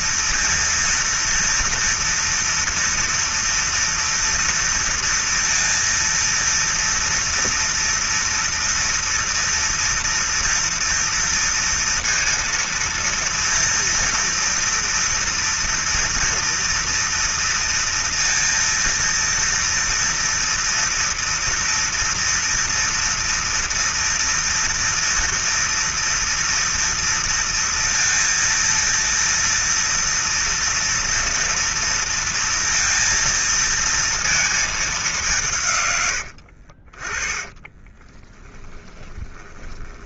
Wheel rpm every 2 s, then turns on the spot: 230, 230, 230, 230, 230, 240, 230, 230, 230, 230, 230, 230, 230, 240, 230, 230, 230, 230, 110, 20.
38-40